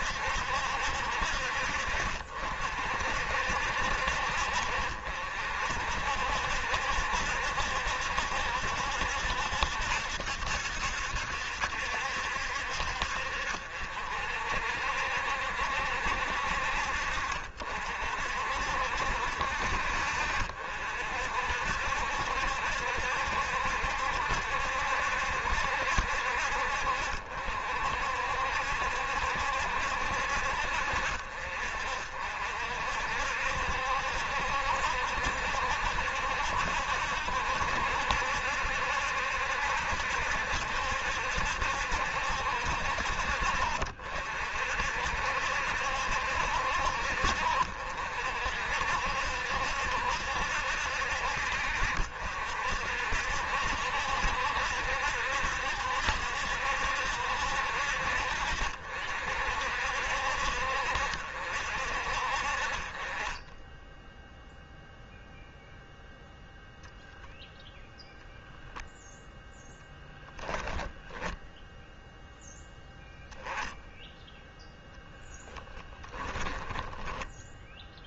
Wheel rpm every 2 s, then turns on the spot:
60, 60, 60, 70, 70, 70, 60, 60, 60, 60, 60, 70, 70, 60, 70, 60, 60, 70, 70, 70, 70, 60, 60, 60, 60, 70, 60, 70, 70, 50, 60, 30, 0, 0, 0, 10, 10, 0, 10.
70-72 76-78